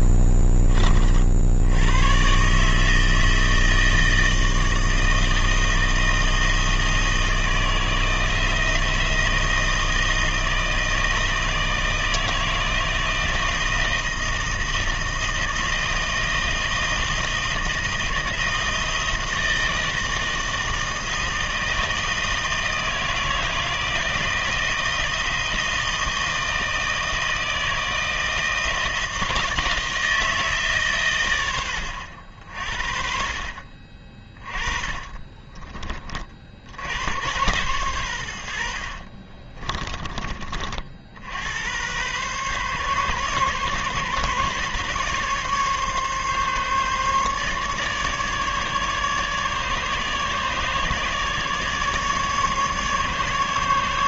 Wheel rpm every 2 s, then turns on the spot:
20, 130, 160, 160, 170, 160, 160, 160, 160, 160, 160, 160, 160, 160, 160, 130, 50, 30, 90, 50, 70, 140, 140, 140, 150, 150, 140.
0-2 34-36 38-40